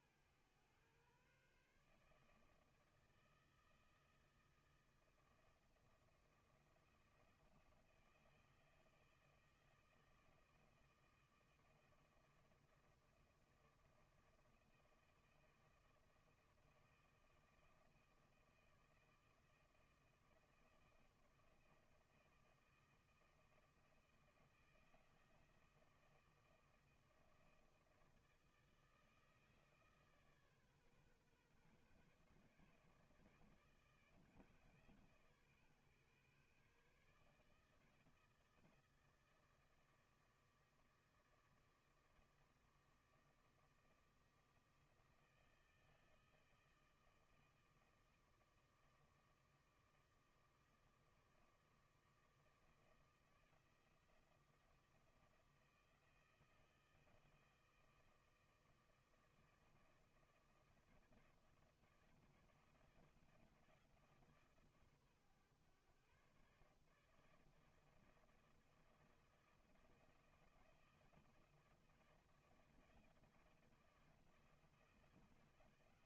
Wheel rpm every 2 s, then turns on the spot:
120, 160, 160, 170, 160, 160, 160, 160, 160, 160, 160, 160, 170, 160, 160, 140, 150, 140, 140, 160, 160, 160, 160, 160, 160, 160, 160, 170, 160, 160, 160, 170, 140, 150, 160, 160, 160, 170.
none